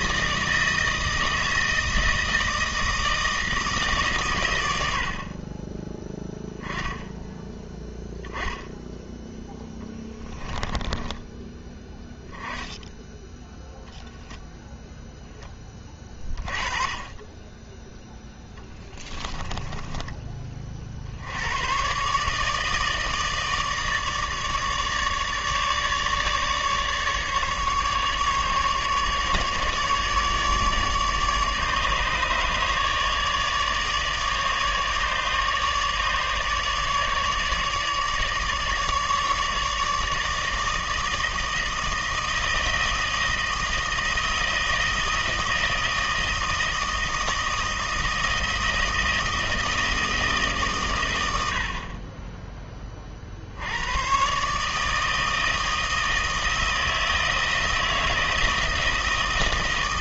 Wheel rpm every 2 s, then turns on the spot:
160, 160, 80, 0, 10, 10, 10, 0, 20, 30, 50, 160, 150, 150, 150, 150, 150, 150, 150, 150, 160, 160, 160, 160, 160, 130, 20, 150, 160, 160.
10-12 18-20